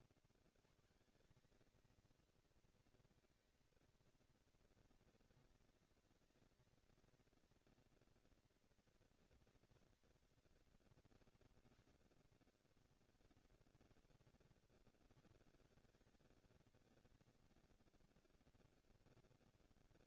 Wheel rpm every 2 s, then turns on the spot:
100, 230, 230, 240, 230, 130, 100, 120, 170, 90.
none